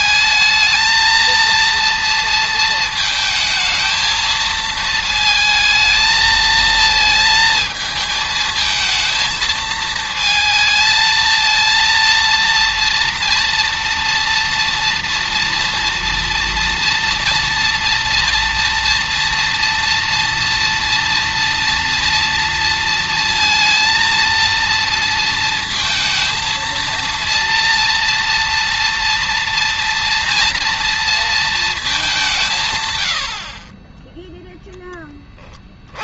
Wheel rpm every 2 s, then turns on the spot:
230, 220, 220, 220, 220, 220, 230, 230, 230, 240, 230, 230, 230, 230, 240, 230, 110, 20.
none